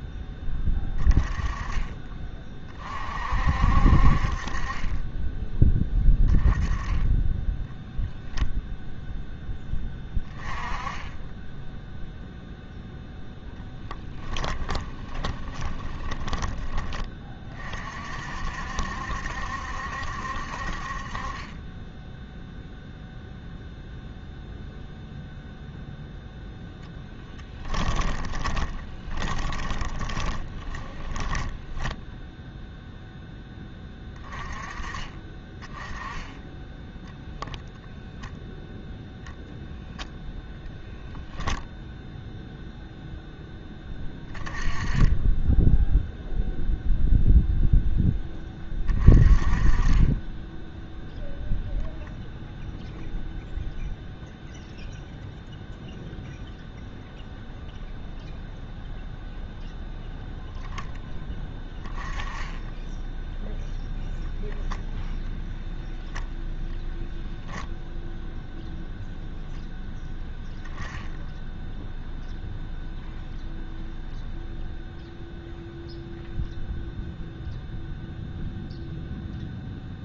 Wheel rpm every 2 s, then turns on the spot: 20, 40, 30, 10, 0, 20, 0, 20, 20, 70, 40, 0, 0, 10, 20, 10, 0, 20, 10, 0, 0, 0, 20, 0, 30, 0, 0, 0, 0, 0, 10, 10, 0, 0, 0, 0, 0, 0, 0, 0.
14-16 28-32